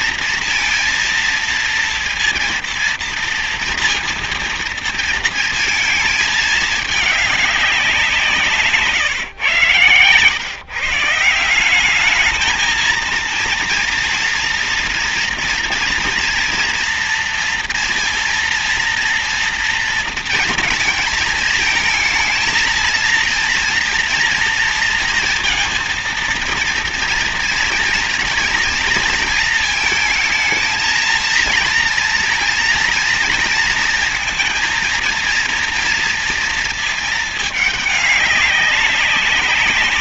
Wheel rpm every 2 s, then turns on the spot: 230, 230, 230, 210, 140, 140, 230, 230, 230, 230, 220, 220, 230, 230, 230, 220, 230, 230, 230, 200.
none